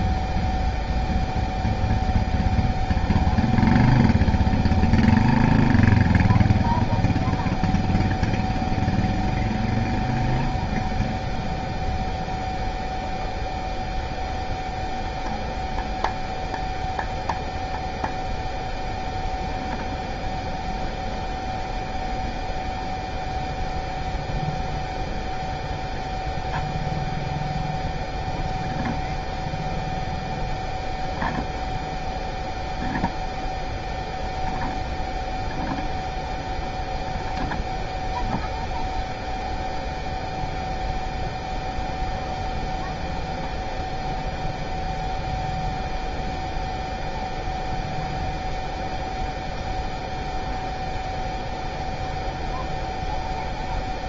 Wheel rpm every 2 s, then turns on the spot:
0, 0, 0, 0, 0, 0, 0, 0, 0, 0, 0, 0, 0, 0, 0, 0, 0, 0, 0, 0, 0, 0, 0, 0, 0, 0, 0.
none